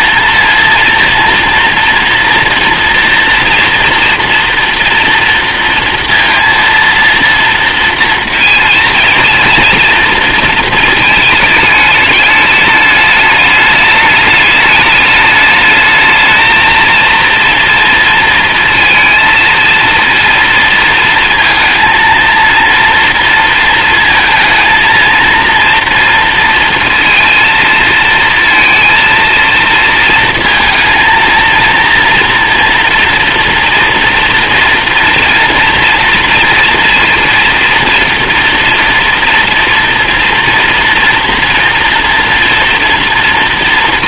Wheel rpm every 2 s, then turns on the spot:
230, 240, 230, 230, 230, 220, 210, 210, 230, 230, 230, 230, 230, 230, 230, 230, 230, 230, 230, 240, 230, 230.
none